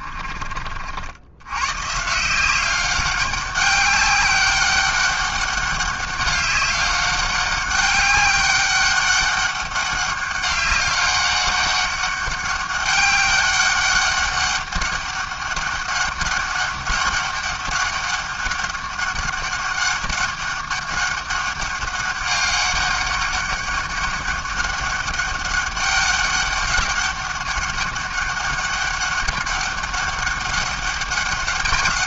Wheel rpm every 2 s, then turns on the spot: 40, 180, 200, 200, 200, 200, 200, 200, 200, 200, 200, 200, 200, 200, 200, 200.
none